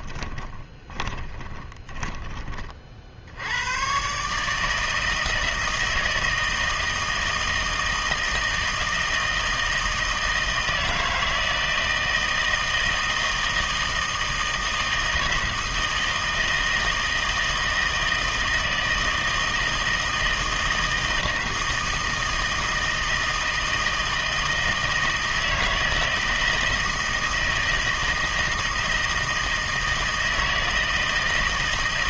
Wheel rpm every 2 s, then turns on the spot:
20, 30, 160, 160, 160, 160, 160, 160, 160, 160, 160, 160, 160, 160, 160, 160.
0-2